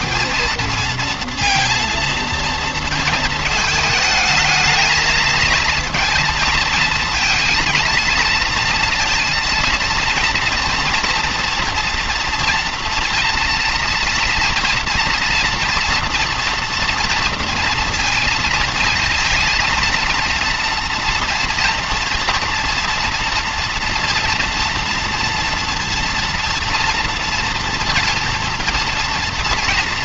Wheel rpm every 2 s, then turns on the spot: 230, 230, 220, 230, 230, 230, 230, 230, 230, 230, 230, 230, 230, 230, 230.
none